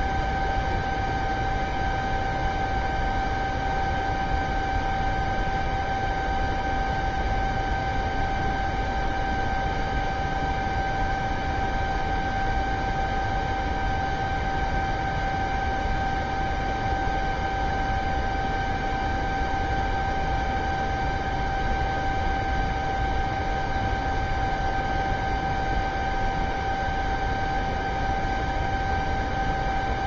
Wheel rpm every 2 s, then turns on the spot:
0, 0, 0, 0, 0, 0, 0, 0, 0, 0, 0, 0, 0, 0, 0.
none